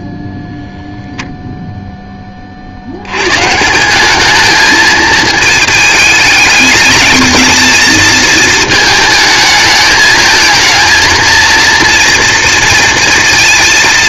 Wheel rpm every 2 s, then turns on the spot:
0, 40, 220, 210, 230, 220, 230.
none